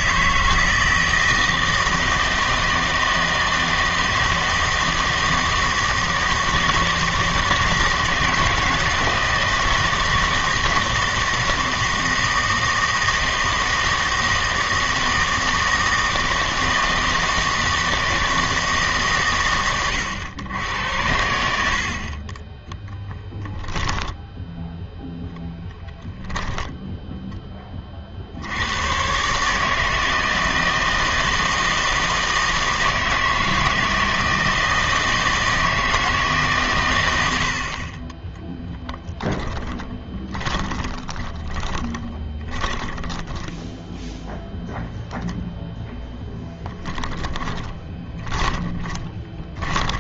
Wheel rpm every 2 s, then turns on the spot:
160, 160, 160, 160, 160, 160, 160, 160, 160, 150, 90, 10, 0, 0, 90, 160, 160, 160, 130, 0, 20, 10, 0, 10, 20.
40-44 46-50